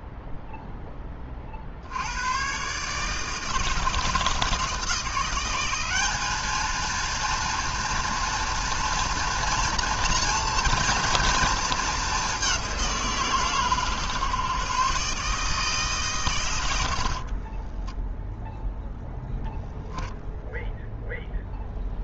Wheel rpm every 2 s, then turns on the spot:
0, 120, 170, 220, 230, 230, 190, 140, 110, 0, 0.
none